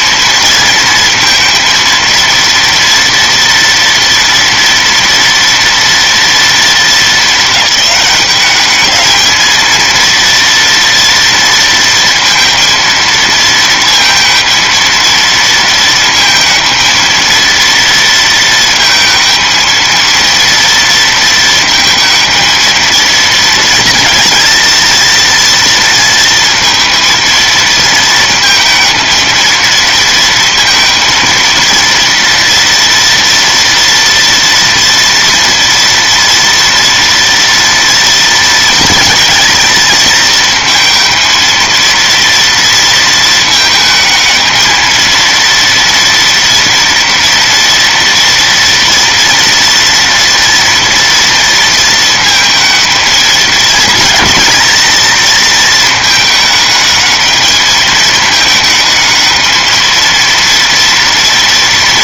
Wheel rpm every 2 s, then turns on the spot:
230, 230, 230, 200, 220, 230, 230, 220, 230, 220, 230, 230, 230, 230, 230, 230, 230, 230, 230, 220, 230, 220, 230, 230, 240, 230, 220, 220, 220, 220, 230.
none